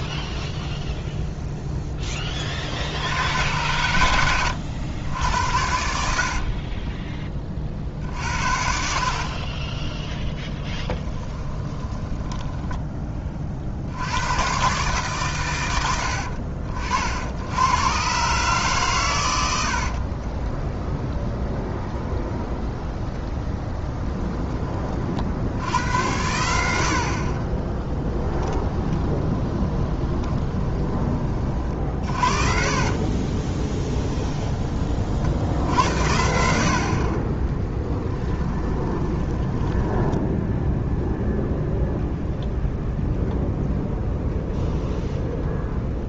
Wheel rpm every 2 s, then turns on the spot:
0, 60, 90, 20, 50, 10, 10, 130, 60, 130, 20, 10, 30, 70, 10, 20, 40, 30, 60, 10, 0, 0, 0.
6-8 20-24 28-34 38-40